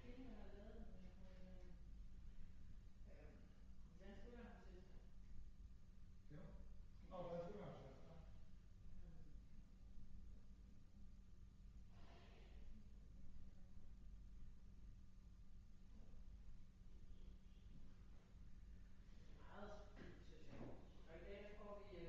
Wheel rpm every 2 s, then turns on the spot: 0, 0, 0, 0, 0, 0, 0, 0, 0, 0, 0.
none